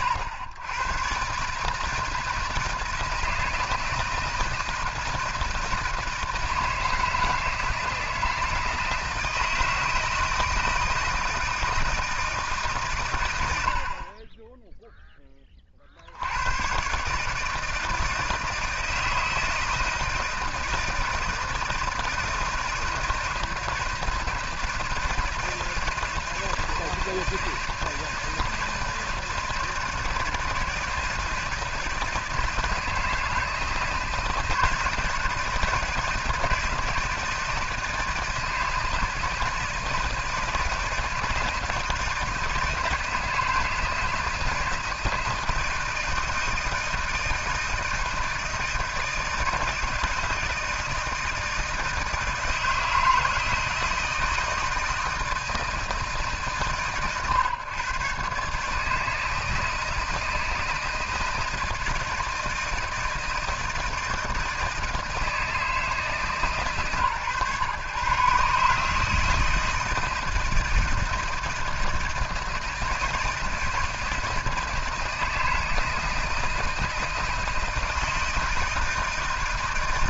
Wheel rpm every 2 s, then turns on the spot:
100, 160, 160, 160, 160, 160, 140, 10, 130, 160, 160, 160, 160, 160, 160, 160, 160, 160, 160, 160, 160, 160, 160, 160, 160, 160, 160, 160, 120, 150, 160, 160, 160, 130, 150, 160, 160, 160, 160, 160.
none